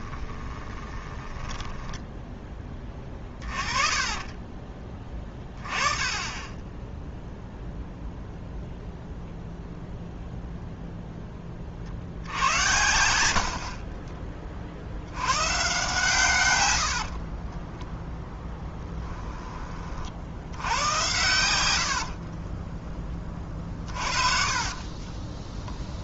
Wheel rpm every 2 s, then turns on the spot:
20, 20, 30, 20, 0, 0, 90, 40, 110, 10, 90, 10, 30.
0-2 16-18 22-26